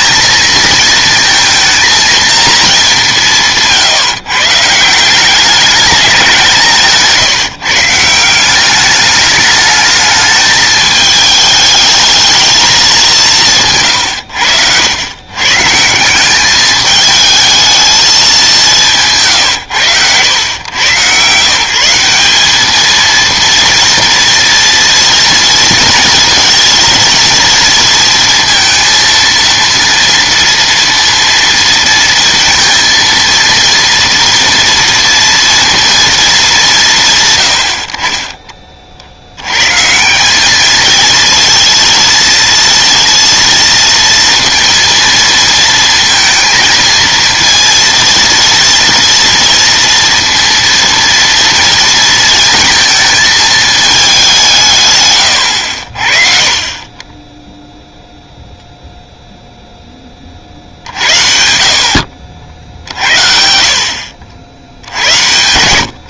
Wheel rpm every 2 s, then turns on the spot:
220, 160, 190, 160, 210, 220, 180, 120, 220, 150, 120, 230, 230, 230, 230, 230, 230, 230, 130, 60, 220, 230, 230, 230, 240, 230, 220, 110, 20, 0, 60, 70, 80.
none